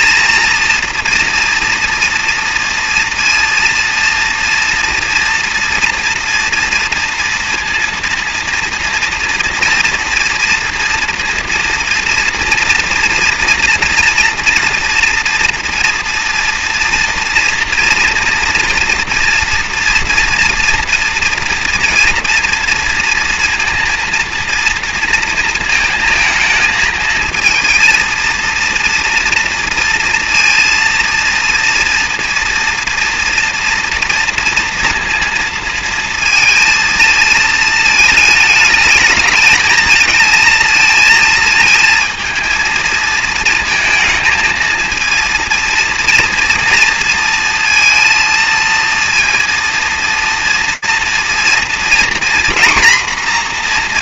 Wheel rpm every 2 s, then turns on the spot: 230, 230, 230, 240, 230, 230, 230, 230, 240, 240, 230, 240, 230, 220, 230, 230, 230, 230, 230, 220, 230, 220, 220, 230, 230, 230, 250.
none